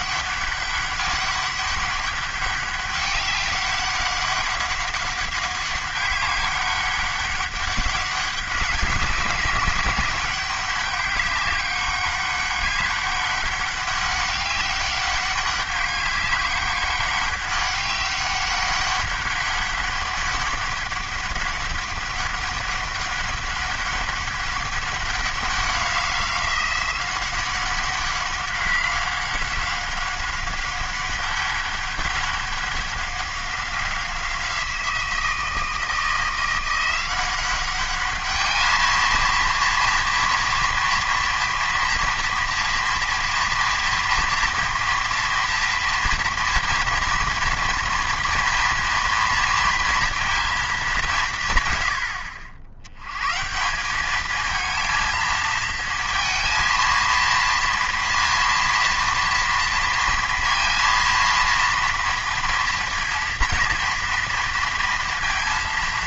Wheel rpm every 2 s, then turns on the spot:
200, 200, 190, 200, 190, 200, 200, 200, 200, 200, 200, 200, 200, 190, 190, 200, 200, 170, 180, 220, 230, 230, 230, 240, 240, 210, 90, 220, 230, 230, 230, 230, 230.
none